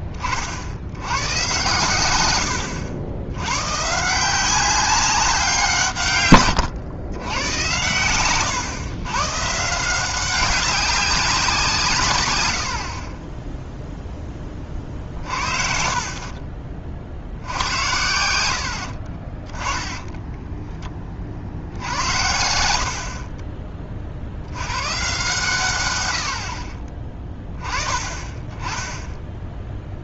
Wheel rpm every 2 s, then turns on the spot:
60, 90, 190, 110, 110, 190, 110, 30, 40, 80, 10, 70, 120, 10, 10.
6-8